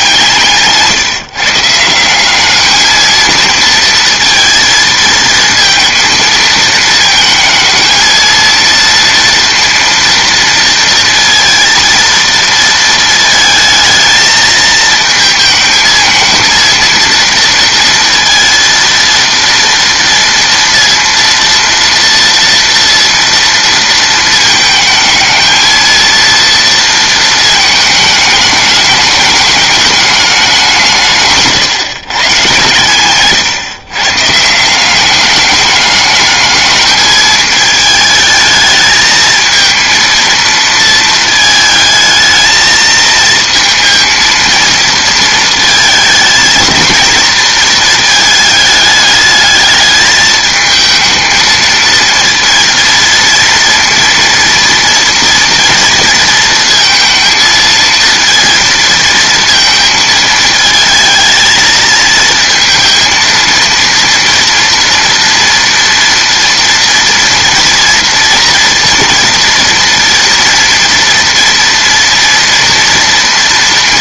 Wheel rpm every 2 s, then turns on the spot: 140, 210, 230, 220, 230, 230, 230, 220, 230, 230, 230, 230, 220, 230, 210, 190, 140, 160, 210, 220, 230, 220, 230, 220, 220, 220, 230, 230, 230, 230, 220, 230, 230, 230, 230, 230, 230.
none